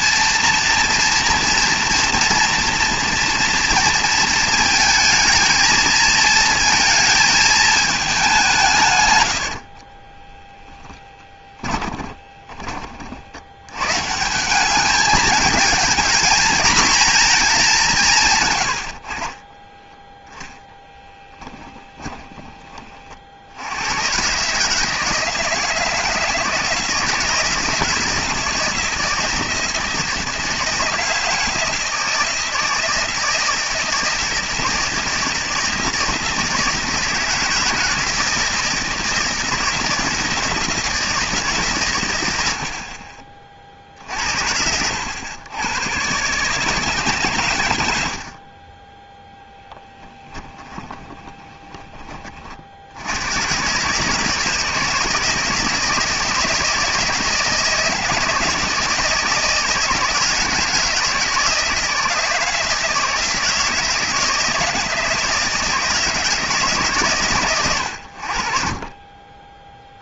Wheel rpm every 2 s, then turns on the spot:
230, 230, 220, 230, 160, 10, 30, 190, 230, 120, 10, 20, 150, 160, 170, 160, 160, 160, 160, 160, 160, 80, 80, 150, 30, 20, 50, 160, 160, 160, 160, 160, 160, 150, 40.
10-12 48-52